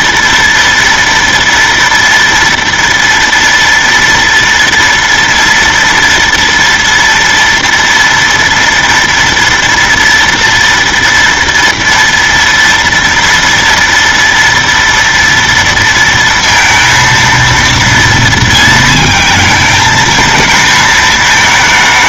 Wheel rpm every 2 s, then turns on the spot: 230, 230, 230, 230, 230, 230, 230, 230, 230, 230, 220.
none